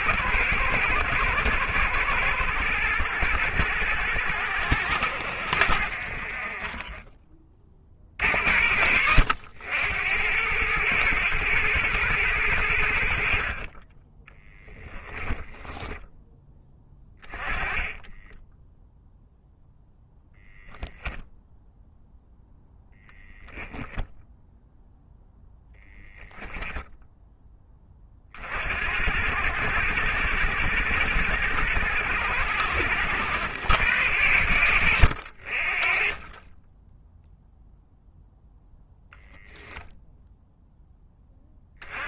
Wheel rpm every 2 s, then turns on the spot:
110, 110, 80, 30, 70, 110, 90, 10, 20, 0, 0, 0, 0, 10, 80, 110, 100, 70, 10, 0, 0.
6-8 14-18 26-28